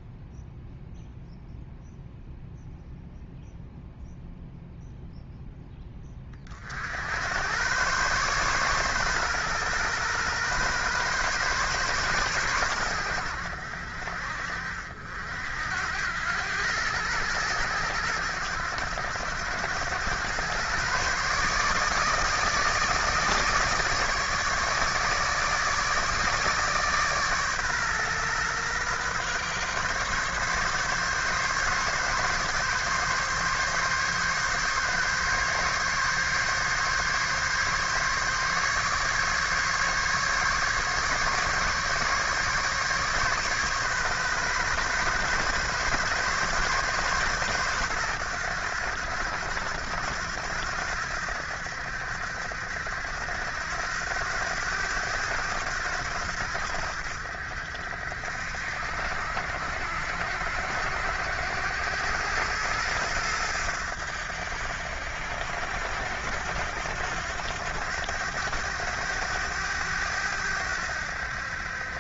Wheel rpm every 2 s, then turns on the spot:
0, 0, 0, 60, 130, 130, 110, 60, 110, 100, 120, 160, 150, 150, 130, 140, 140, 140, 140, 140, 140, 140, 140, 140, 100, 80, 70, 100, 70, 70, 90, 100, 80, 90, 100, 80.
none